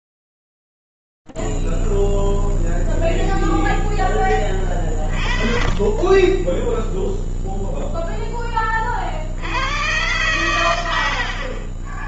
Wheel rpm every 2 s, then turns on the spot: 0, 0, 10, 20, 0, 100.
none